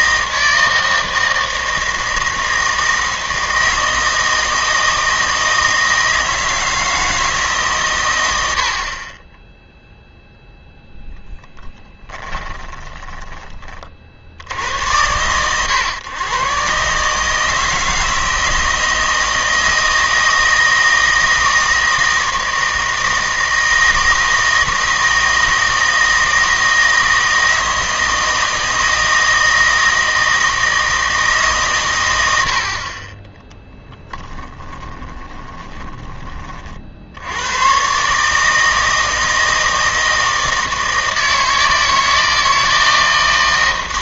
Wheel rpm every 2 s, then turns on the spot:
160, 160, 160, 160, 70, 0, 20, 100, 130, 160, 160, 160, 160, 160, 160, 160, 70, 10, 50, 160, 160, 160.
12-14 34-36